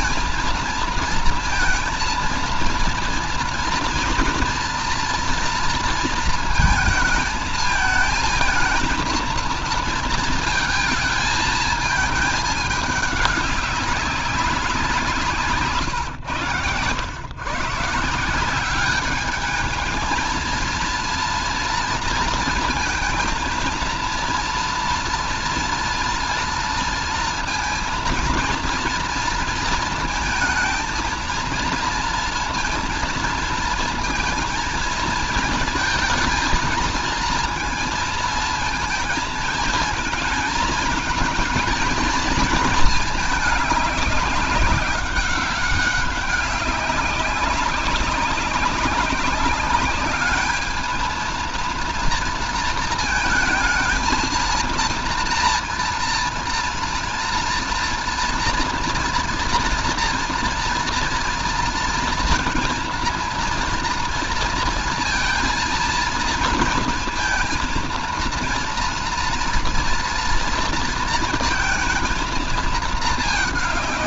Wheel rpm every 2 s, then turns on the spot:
230, 230, 230, 230, 220, 220, 210, 190, 110, 180, 220, 220, 230, 230, 230, 220, 230, 230, 220, 230, 220, 230, 200, 200, 200, 210, 230, 230, 230, 230, 230, 230, 230, 230, 230, 230, 220.
none